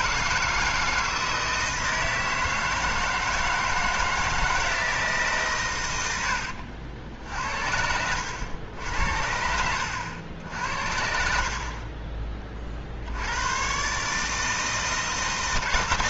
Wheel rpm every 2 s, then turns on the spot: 160, 160, 160, 80, 90, 70, 40, 160.
none